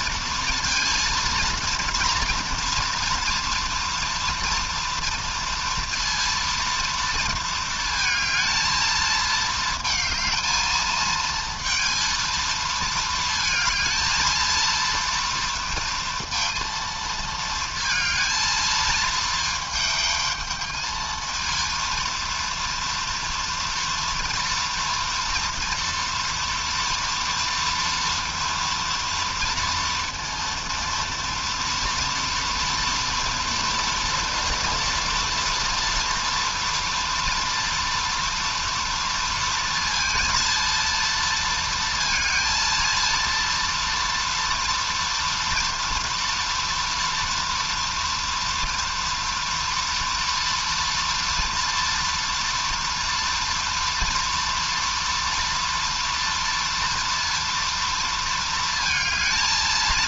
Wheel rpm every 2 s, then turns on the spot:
230, 230, 240, 230, 220, 220, 230, 230, 230, 220, 220, 230, 230, 230, 230, 230, 230, 230, 230, 230, 230, 230, 230, 230, 230, 230, 230, 230, 230, 220.
none